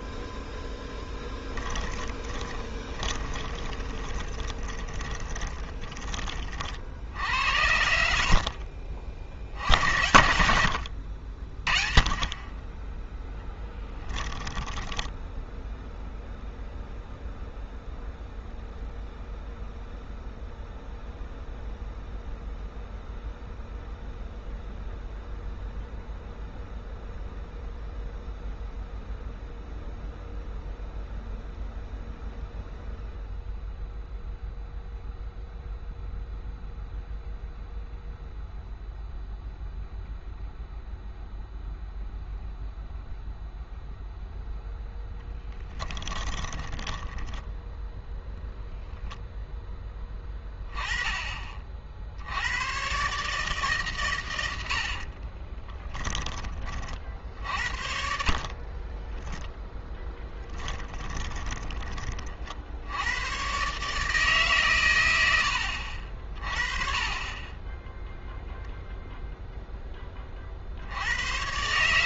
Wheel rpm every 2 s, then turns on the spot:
0, 10, 20, 50, 40, 70, 10, 10, 0, 0, 0, 0, 0, 0, 0, 0, 0, 0, 0, 0, 0, 0, 0, 20, 0, 10, 100, 80, 40, 30, 10, 60, 130, 30, 0, 60.
2-6 14-16 46-48 54-56 58-62